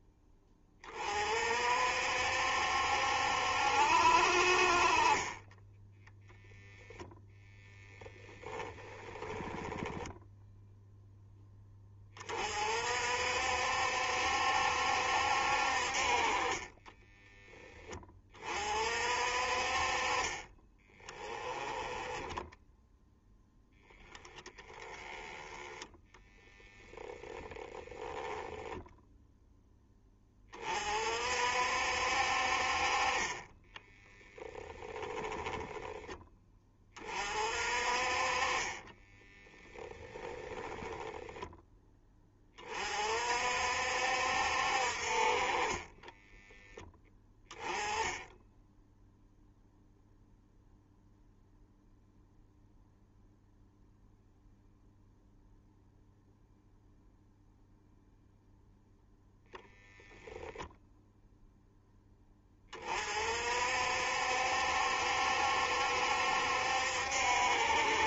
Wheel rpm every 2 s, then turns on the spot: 30, 70, 40, 0, 10, 0, 50, 70, 20, 40, 20, 0, 10, 0, 0, 40, 40, 20, 20, 20, 10, 40, 50, 10, 0, 0, 0, 0, 0, 0, 10, 40, 70, 70.
16-18 34-36 38-42